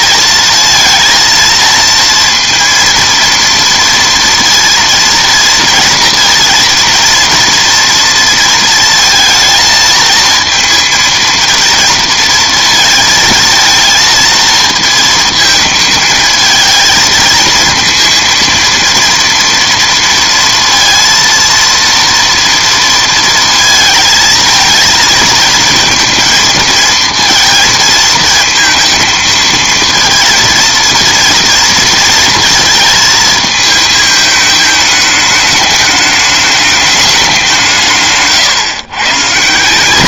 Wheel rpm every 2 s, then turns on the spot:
230, 230, 230, 230, 230, 230, 230, 230, 220, 230, 230, 230, 220, 220, 220, 230, 230, 210, 210, 140.
none